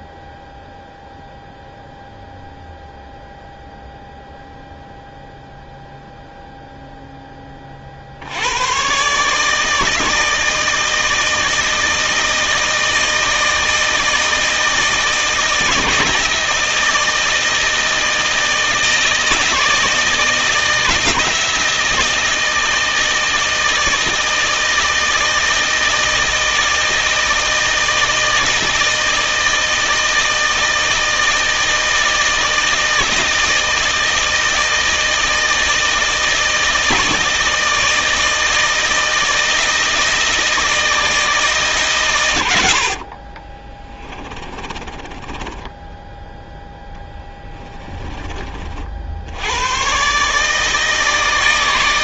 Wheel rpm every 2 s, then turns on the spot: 0, 0, 0, 0, 110, 160, 160, 160, 160, 160, 160, 160, 160, 160, 160, 160, 160, 160, 160, 160, 160, 70, 30, 20, 40, 160.
44-48